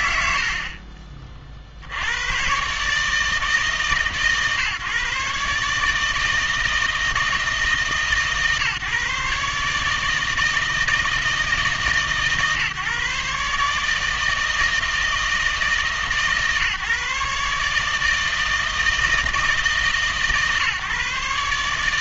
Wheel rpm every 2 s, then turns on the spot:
80, 130, 140, 160, 150, 160, 140, 160, 150, 160, 140.
none